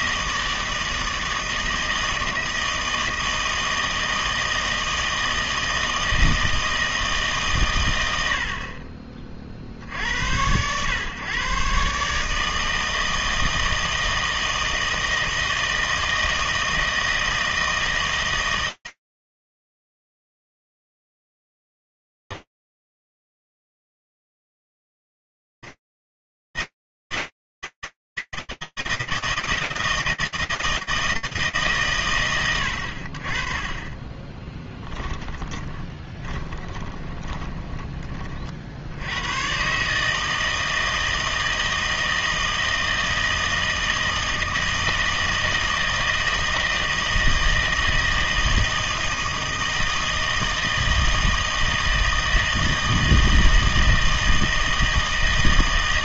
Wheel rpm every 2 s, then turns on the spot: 160, 160, 160, 160, 50, 110, 160, 160, 160, 160, 160, 160, 160, 150, 30, 20, 20, 150, 160, 160, 160, 160, 160, 160, 160, 160, 160, 160.
30-32